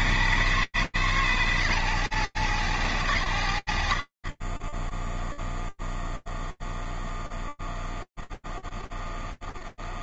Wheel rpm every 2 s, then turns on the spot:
170, 140, 0, 0, 0.
none